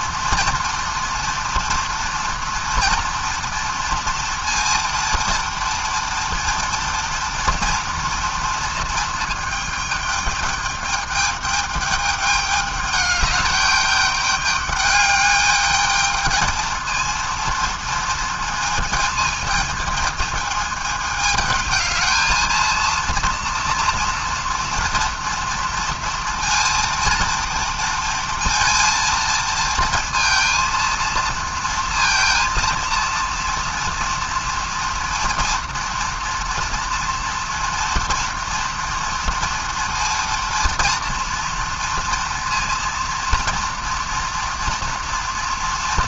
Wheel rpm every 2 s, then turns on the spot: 230, 230, 230, 230, 230, 210, 200, 210, 220, 220, 220, 230, 230, 230, 230, 230, 230, 230, 240, 230, 230, 230, 240.
none